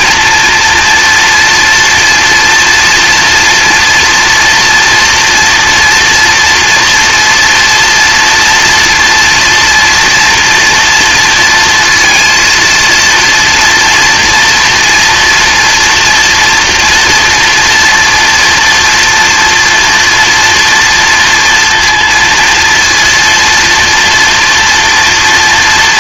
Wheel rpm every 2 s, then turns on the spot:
230, 230, 230, 230, 230, 230, 230, 230, 230, 230, 240, 230, 230.
none